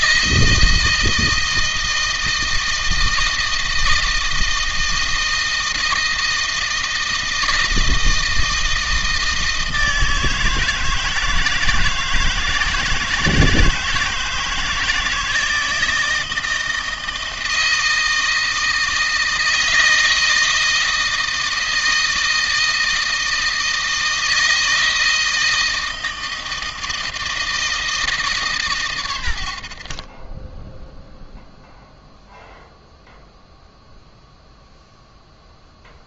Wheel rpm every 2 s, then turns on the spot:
160, 160, 160, 160, 160, 160, 160, 160, 160, 160, 160, 160, 160, 160, 140, 10, 0, 0.
none